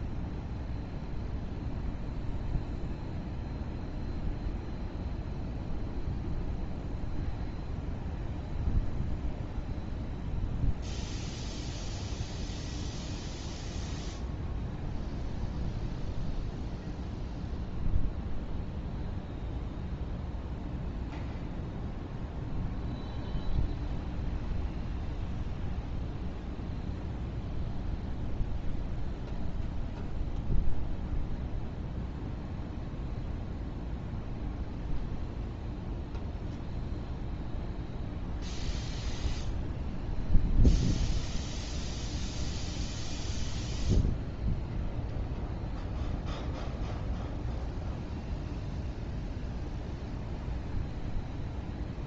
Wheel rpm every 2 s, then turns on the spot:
0, 0, 0, 0, 0, 0, 0, 0, 0, 0, 0, 0, 0, 0, 0, 0, 0, 0, 0, 0, 0, 0, 0, 0, 0, 0.
none